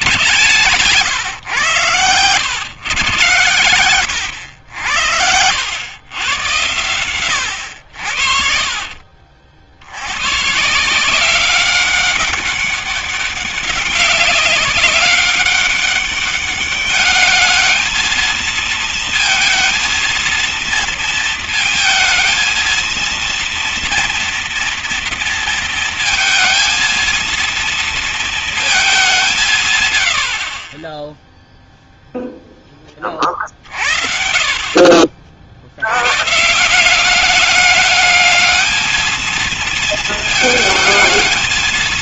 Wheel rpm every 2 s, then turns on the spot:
140, 110, 90, 110, 60, 130, 200, 190, 200, 220, 230, 230, 230, 230, 220, 50, 20, 40, 170, 210, 220.
0-2